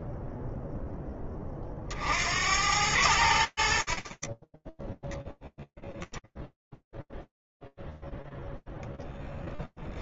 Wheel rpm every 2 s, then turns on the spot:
10, 80, 0, 0, 0.
none